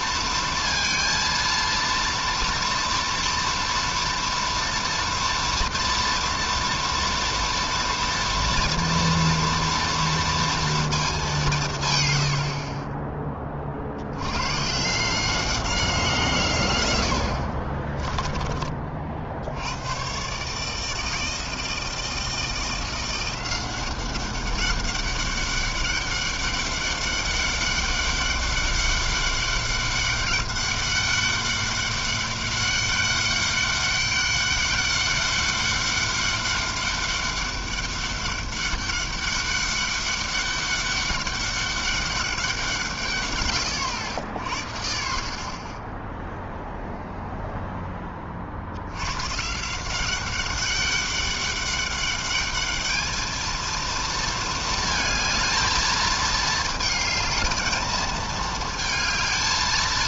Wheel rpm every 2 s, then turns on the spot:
230, 230, 230, 240, 230, 190, 20, 180, 70, 70, 160, 180, 200, 200, 200, 200, 200, 200, 200, 200, 200, 130, 30, 0, 130, 200, 220, 220, 220, 220.
none